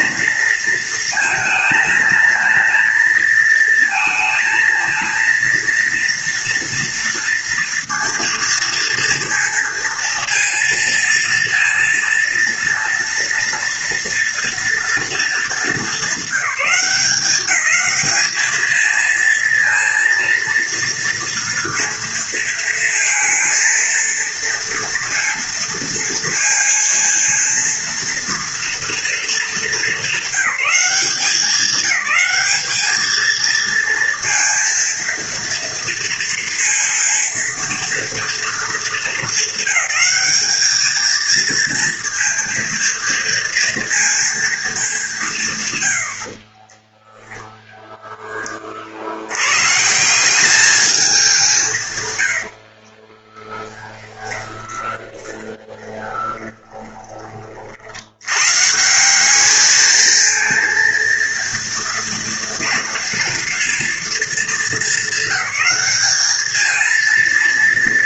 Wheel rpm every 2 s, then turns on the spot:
220, 230, 230, 230, 230, 230, 230, 230, 190, 220, 230, 220, 230, 230, 230, 200, 220, 230, 230, 210, 220, 230, 190, 20, 70, 200, 20, 20, 30, 180, 230, 240, 220, 230.
46-48 52-56